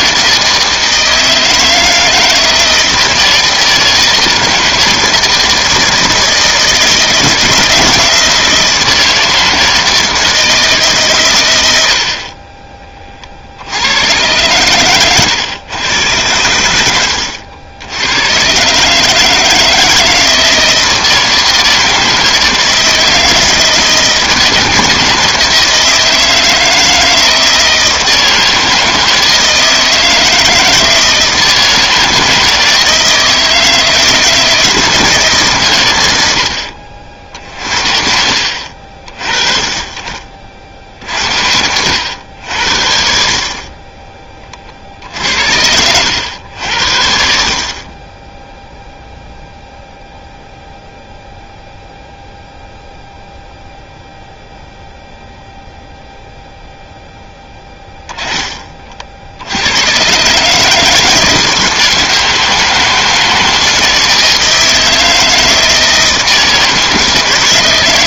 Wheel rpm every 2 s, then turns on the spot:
160, 160, 160, 160, 160, 150, 30, 110, 100, 130, 160, 160, 160, 160, 160, 160, 160, 160, 80, 50, 50, 70, 40, 80, 0, 0, 0, 0, 0, 30, 150, 160, 160, 160.
none